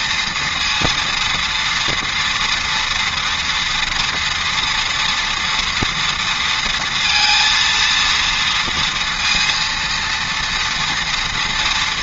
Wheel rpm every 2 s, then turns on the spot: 230, 230, 230, 230, 230, 230.
none